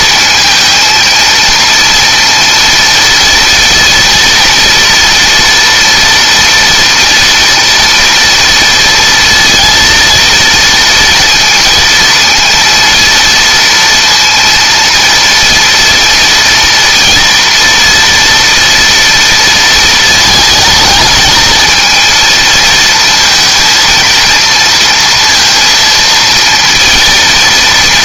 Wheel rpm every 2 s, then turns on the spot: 230, 230, 230, 230, 230, 230, 230, 230, 230, 230, 220, 230, 230, 230.
none